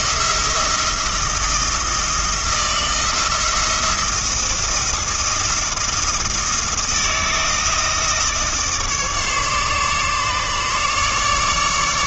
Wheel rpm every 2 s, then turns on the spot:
170, 170, 170, 170, 150, 150.
none